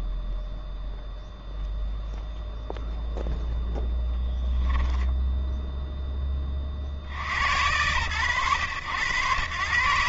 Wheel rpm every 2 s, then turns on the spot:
0, 0, 0, 10, 110.
none